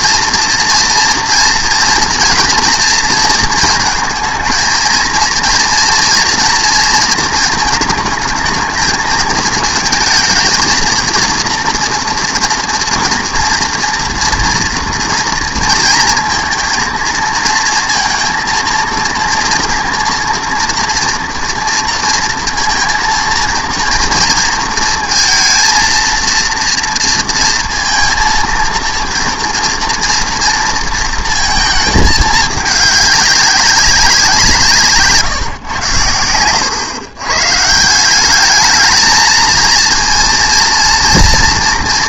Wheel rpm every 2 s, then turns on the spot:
240, 240, 230, 230, 220, 220, 230, 230, 230, 230, 230, 230, 230, 230, 230, 230, 210, 170, 110, 210, 230.
none